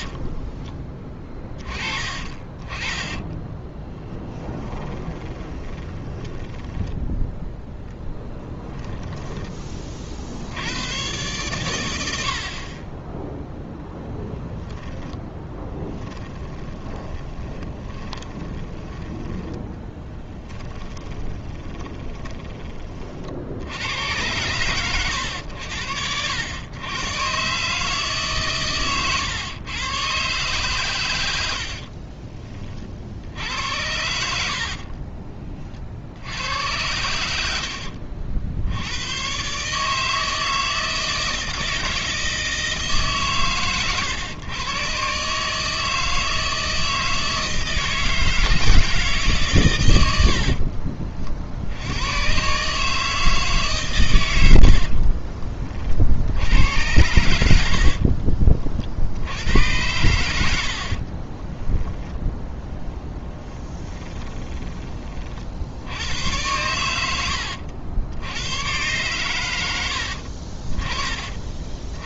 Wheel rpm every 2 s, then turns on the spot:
20, 30, 10, 10, 10, 80, 40, 10, 20, 20, 10, 20, 110, 100, 130, 120, 30, 50, 90, 70, 160, 160, 120, 160, 160, 40, 140, 80, 90, 50, 70, 20, 20, 90, 120, 40.
0-6 8-10 16-22 34-36 50-52 54-56 60-64